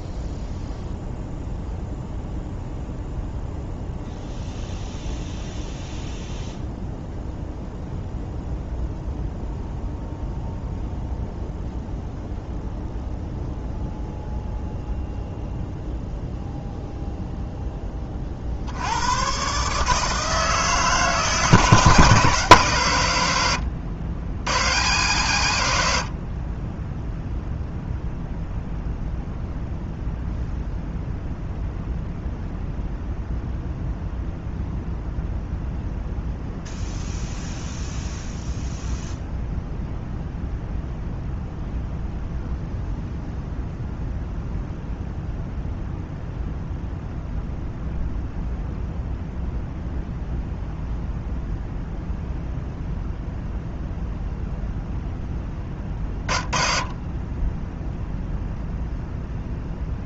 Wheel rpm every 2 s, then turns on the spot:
0, 0, 0, 0, 0, 0, 0, 0, 0, 90, 160, 130, 110, 20, 0, 0, 0, 0, 0, 0, 0, 0, 0, 0, 0, 0, 0, 0, 30, 0.
none